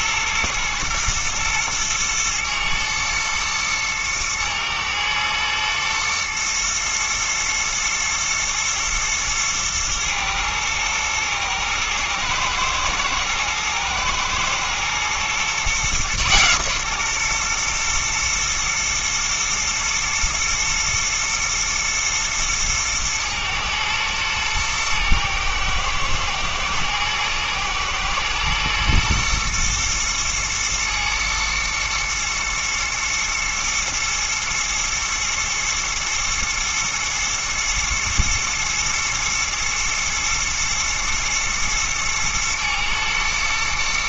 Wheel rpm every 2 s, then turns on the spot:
120, 110, 110, 110, 110, 110, 120, 120, 130, 120, 120, 110, 110, 110, 120, 110, 120, 120, 110, 120, 120, 110.
none